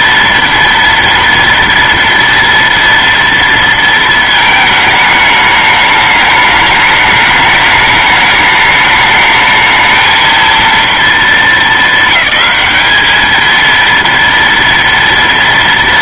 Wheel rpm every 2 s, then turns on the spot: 230, 230, 220, 210, 210, 230, 200, 230.
none